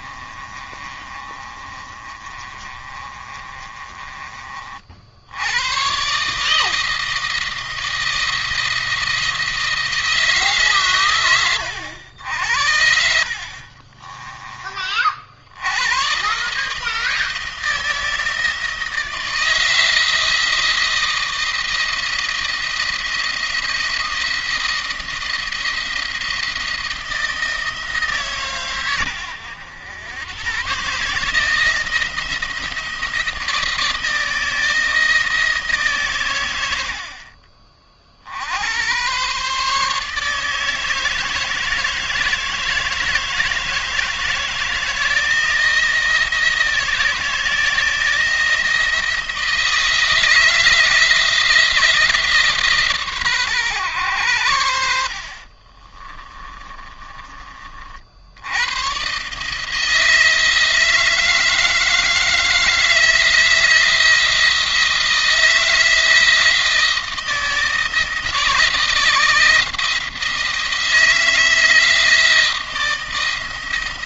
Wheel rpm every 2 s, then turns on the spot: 30, 30, 50, 160, 170, 140, 70, 30, 150, 160, 170, 170, 170, 170, 120, 130, 160, 160, 90, 90, 160, 160, 160, 170, 170, 170, 150, 90, 30, 100, 160, 160, 170, 160, 160, 170, 160.
0-4 56-58